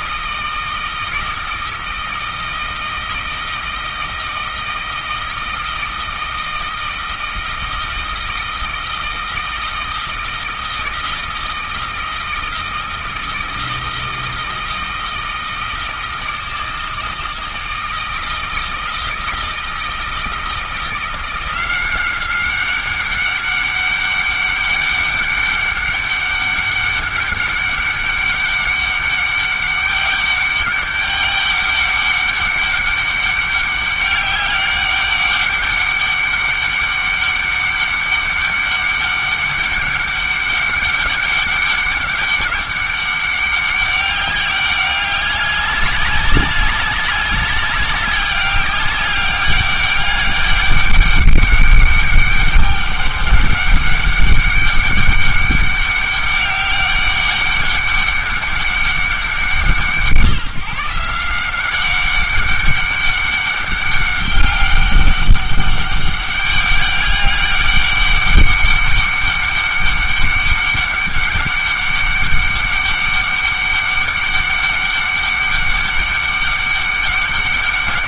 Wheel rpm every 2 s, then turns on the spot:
160, 160, 160, 160, 160, 160, 160, 160, 160, 160, 160, 190, 200, 200, 200, 200, 200, 200, 200, 200, 200, 200, 200, 190, 200, 200, 200, 200, 200, 200, 170, 200, 200, 200, 200, 200, 200, 200, 200.
none